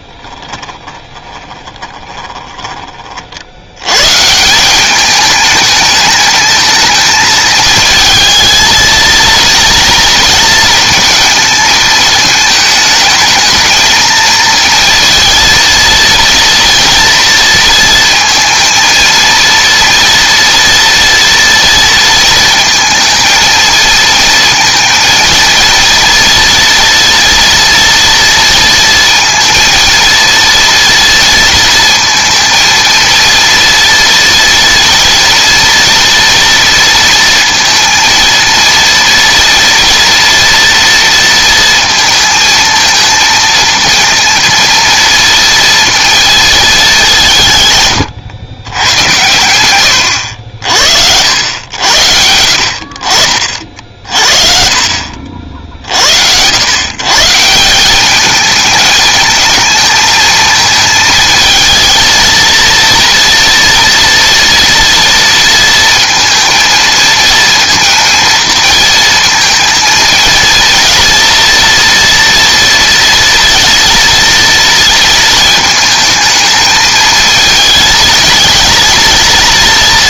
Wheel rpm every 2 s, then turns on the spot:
20, 20, 190, 220, 220, 220, 220, 230, 230, 230, 230, 230, 230, 230, 230, 230, 230, 230, 230, 230, 230, 230, 230, 220, 110, 60, 60, 50, 120, 220, 220, 230, 230, 230, 230, 230, 230, 230, 220, 230.
0-2